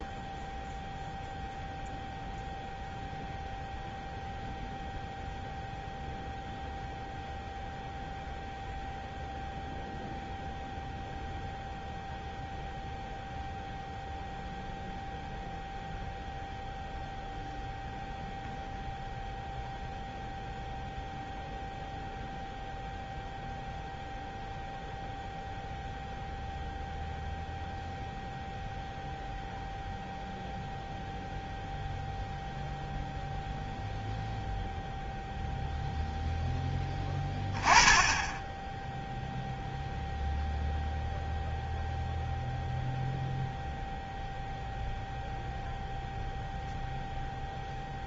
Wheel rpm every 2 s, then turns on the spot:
0, 0, 0, 0, 0, 0, 0, 0, 0, 0, 0, 0, 0, 0, 0, 0, 0, 0, 10, 0, 0, 0, 0, 0.
none